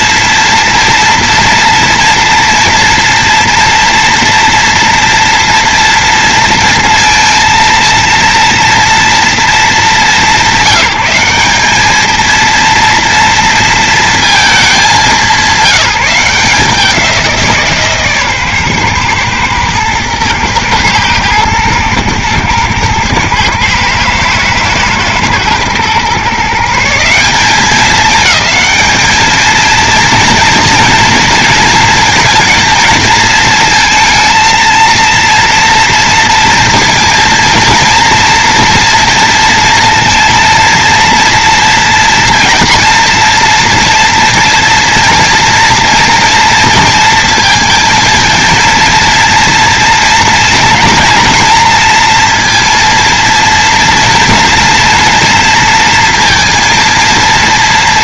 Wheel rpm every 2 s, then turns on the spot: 230, 230, 230, 230, 240, 200, 230, 190, 170, 130, 120, 110, 110, 170, 220, 230, 230, 230, 230, 230, 230, 240, 240, 230, 230, 230, 230, 230, 230.
none